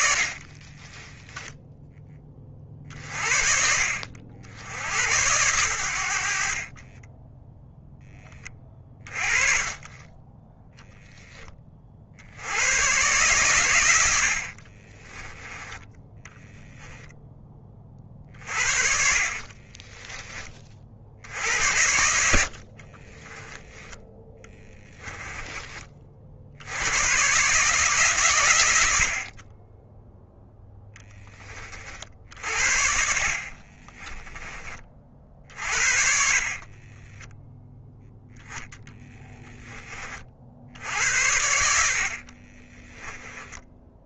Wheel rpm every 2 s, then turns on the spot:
20, 40, 80, 30, 30, 10, 110, 30, 10, 50, 40, 40, 20, 90, 80, 10, 50, 30, 20, 10, 70, 20.
0-2 6-8 14-16 18-20 22-26 36-40 42-44